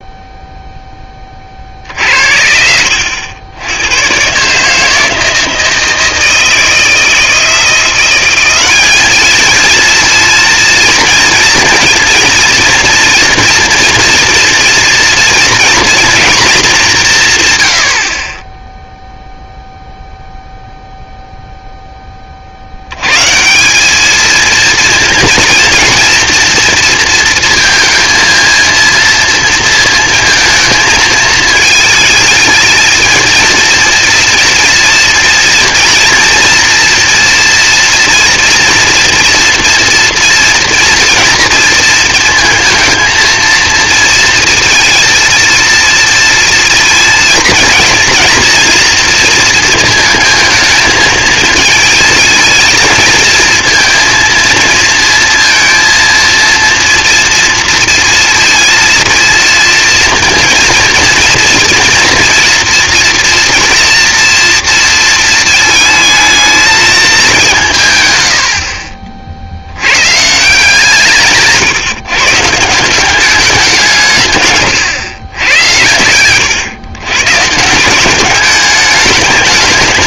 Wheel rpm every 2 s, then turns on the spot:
0, 70, 150, 160, 200, 230, 230, 230, 200, 0, 0, 80, 230, 230, 230, 220, 230, 230, 230, 230, 230, 230, 230, 230, 230, 220, 220, 230, 230, 230, 230, 230, 230, 220, 60, 150, 170, 130, 120, 200.
none